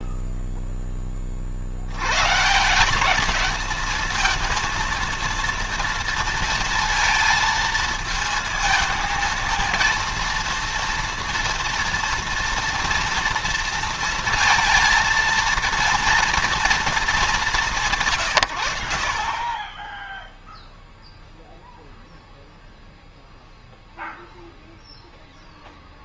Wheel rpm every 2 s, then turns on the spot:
0, 130, 230, 230, 220, 230, 230, 230, 230, 100, 0, 0, 0.
none